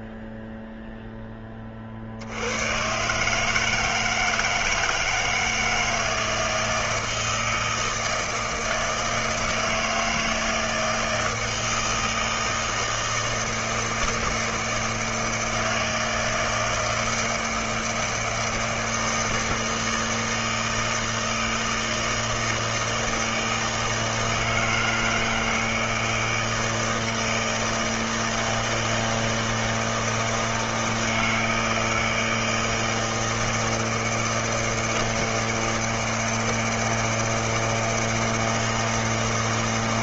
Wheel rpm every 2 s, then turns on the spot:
0, 90, 160, 160, 160, 170, 160, 160, 160, 160, 160, 160, 160, 160, 160, 160, 160, 160, 160, 160.
none